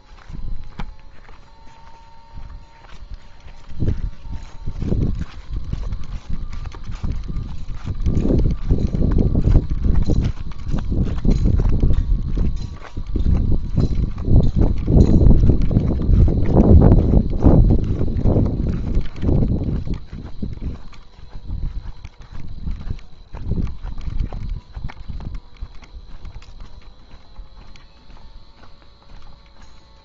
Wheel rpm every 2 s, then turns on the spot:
0, 0, 0, 0, 0, 0, 0, 0, 0, 0, 0, 0, 0, 0, 0.
none